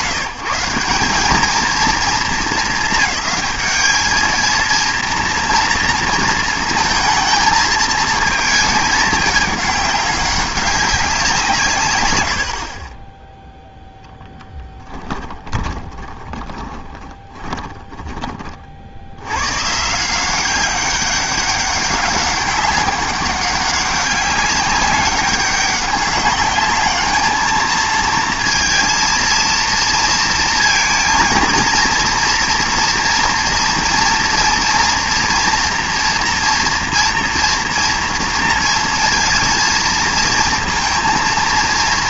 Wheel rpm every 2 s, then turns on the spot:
160, 200, 230, 230, 220, 200, 60, 10, 20, 40, 190, 200, 200, 200, 230, 230, 240, 230, 230, 230, 230.
14-18